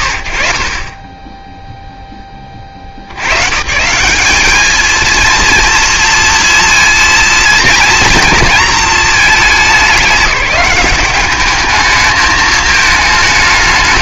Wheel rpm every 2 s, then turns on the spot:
50, 50, 210, 230, 230, 210, 220.
none